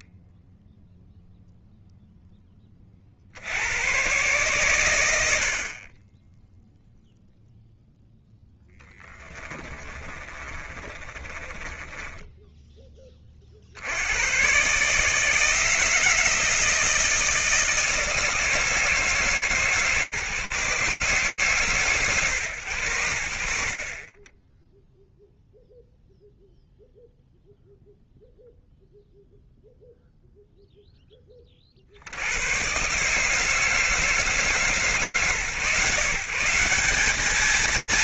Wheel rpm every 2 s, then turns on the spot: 10, 10, 120, 10, 10, 30, 40, 160, 170, 150, 150, 80, 0, 0, 0, 30, 150, 140, 210.
8-12